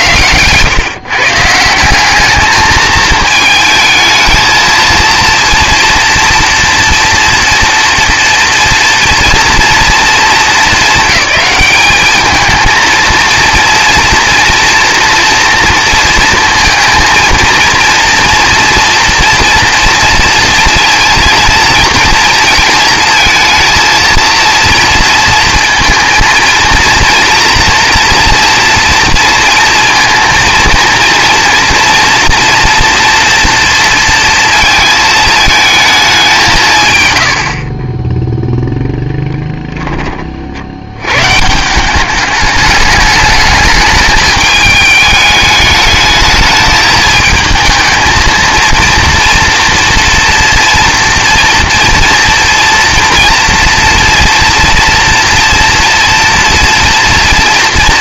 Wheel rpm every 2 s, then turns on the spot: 130, 220, 230, 230, 230, 220, 230, 230, 220, 230, 230, 230, 230, 230, 230, 230, 230, 230, 150, 0, 70, 210, 210, 210, 230, 230, 230, 240, 230.
none